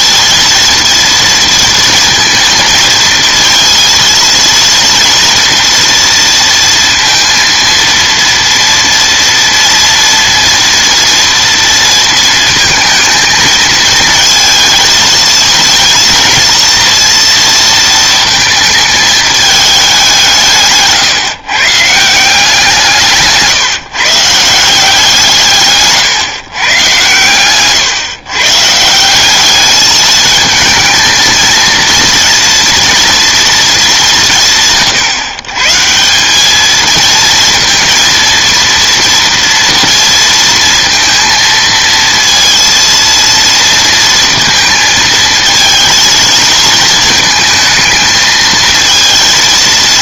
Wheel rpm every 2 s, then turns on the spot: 230, 230, 230, 230, 230, 230, 220, 220, 230, 210, 120, 160, 150, 120, 200, 230, 230, 120, 230, 230, 230, 230, 220, 220, 230.
22-24